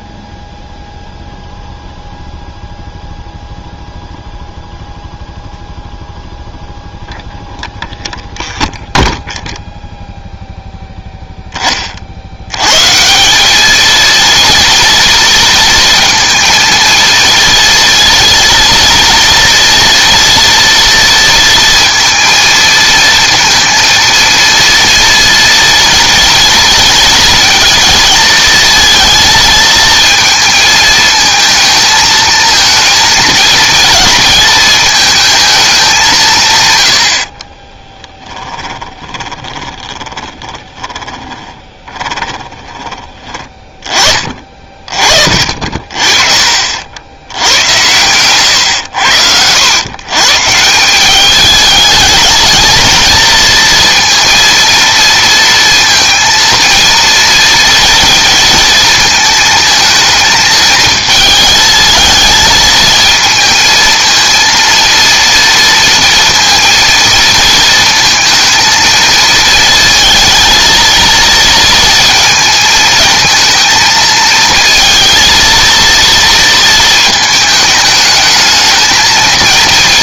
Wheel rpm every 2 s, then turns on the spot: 0, 0, 0, 0, 0, 0, 120, 230, 230, 230, 230, 230, 230, 230, 230, 220, 220, 220, 110, 10, 10, 30, 30, 50, 110, 170, 230, 230, 230, 230, 220, 220, 230, 230, 230, 230, 220, 230, 230, 220.
38-42